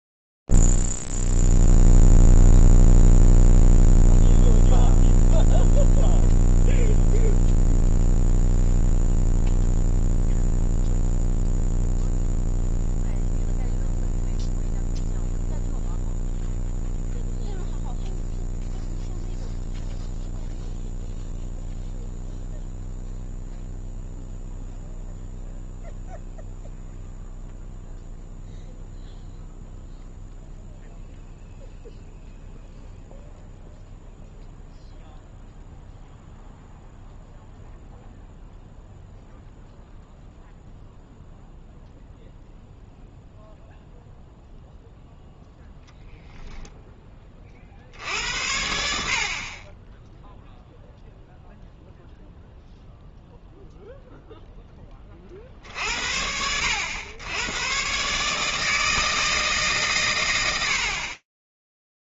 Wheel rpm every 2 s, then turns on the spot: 0, 0, 0, 0, 0, 0, 0, 0, 0, 0, 0, 0, 0, 0, 0, 0, 0, 0, 0, 0, 0, 0, 0, 10, 70, 0, 0, 10, 90, 160, 60.
none